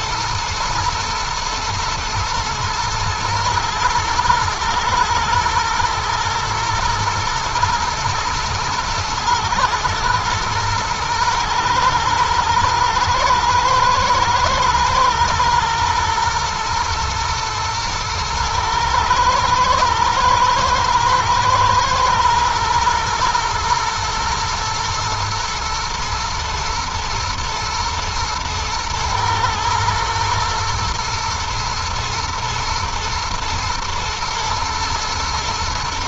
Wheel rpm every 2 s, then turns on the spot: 110, 110, 110, 110, 120, 110, 120, 120, 120, 110, 110, 120, 120, 120, 110, 110, 120, 120.
none